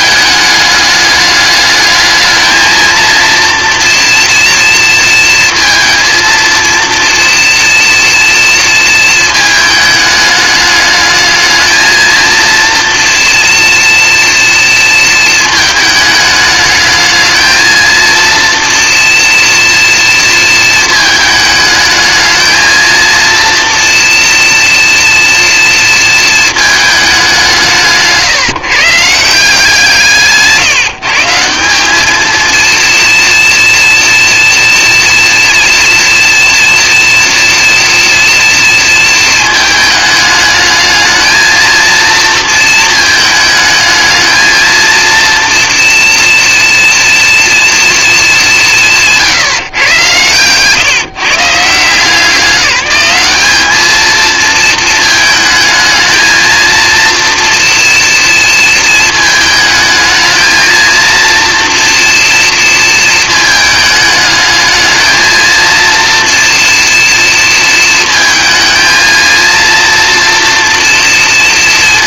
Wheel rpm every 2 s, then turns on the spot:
210, 230, 230, 230, 220, 210, 230, 230, 220, 230, 220, 230, 230, 200, 150, 160, 230, 230, 230, 230, 220, 220, 230, 230, 170, 150, 200, 220, 230, 220, 230, 230, 220, 230, 220, 230.
none